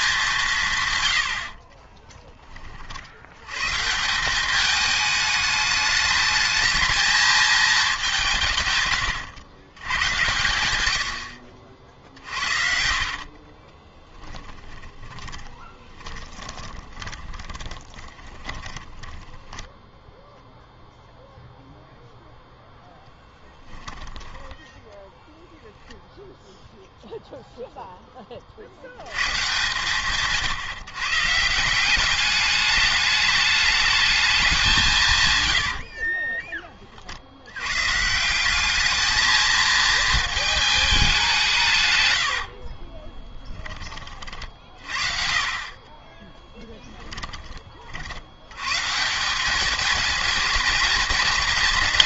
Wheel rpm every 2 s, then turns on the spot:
160, 30, 210, 220, 140, 100, 50, 10, 20, 10, 0, 0, 10, 0, 60, 150, 210, 190, 30, 200, 220, 50, 50, 10, 130, 220.
12-20 42-44 46-48